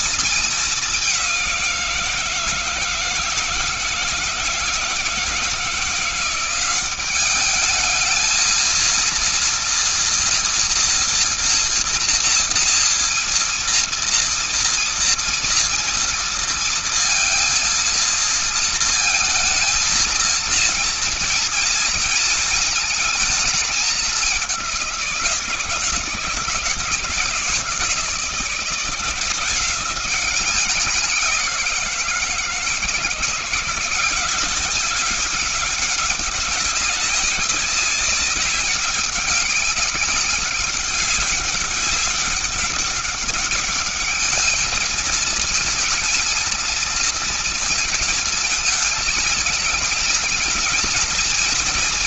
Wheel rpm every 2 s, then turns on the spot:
220, 170, 160, 180, 220, 240, 230, 230, 230, 230, 230, 230, 200, 160, 170, 190, 170, 190, 200, 190, 200, 200, 210, 230, 220, 220.
none